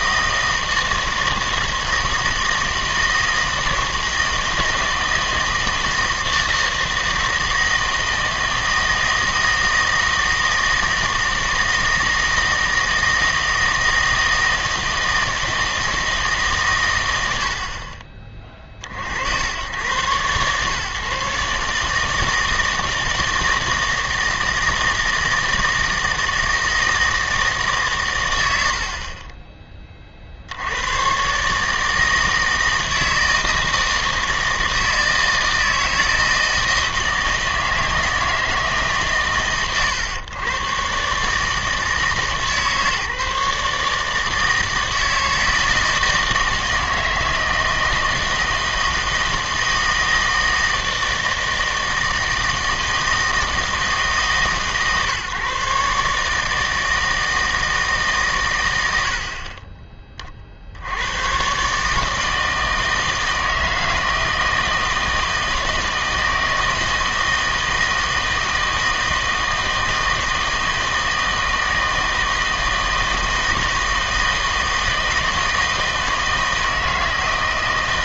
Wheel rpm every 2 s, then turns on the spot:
160, 160, 160, 160, 160, 160, 160, 160, 130, 40, 130, 160, 160, 160, 70, 90, 160, 160, 160, 150, 120, 150, 160, 160, 160, 160, 160, 150, 160, 100, 60, 160, 170, 160, 160, 160, 160, 160, 160.
none